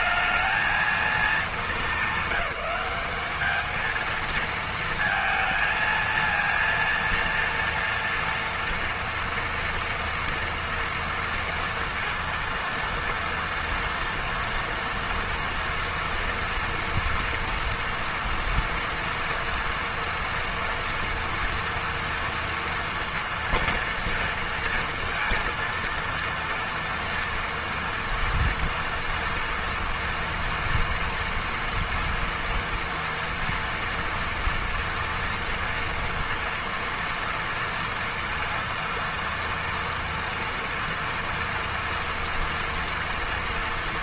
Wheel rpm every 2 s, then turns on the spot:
220, 200, 220, 230, 230, 230, 230, 240, 230, 230, 230, 230, 230, 230, 230, 230, 240, 230, 230, 230, 230, 230.
none